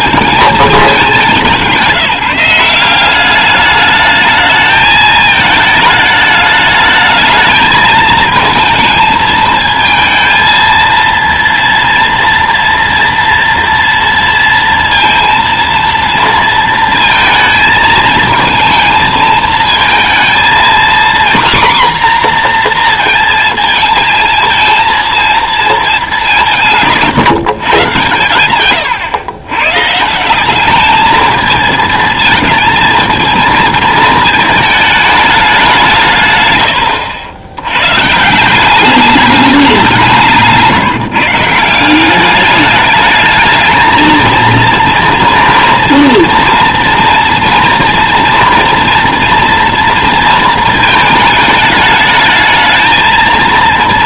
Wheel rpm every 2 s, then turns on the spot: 200, 180, 220, 210, 220, 230, 230, 230, 230, 220, 240, 240, 230, 170, 120, 210, 230, 210, 100, 190, 160, 210, 230, 230, 230, 220, 220.
36-38